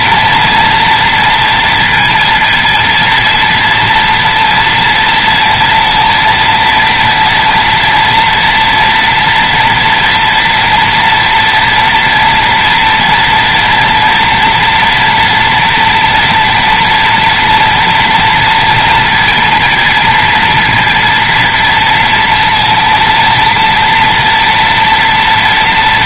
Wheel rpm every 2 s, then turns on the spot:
240, 230, 230, 230, 230, 230, 230, 230, 230, 230, 230, 230, 230.
none